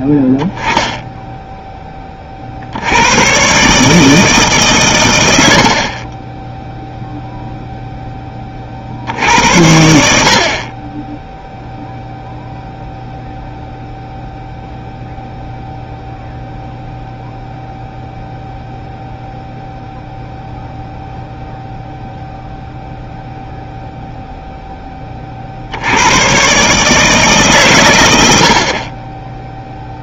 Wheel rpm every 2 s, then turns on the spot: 0, 60, 150, 10, 40, 40, 0, 0, 0, 0, 0, 0, 0, 140, 60.
none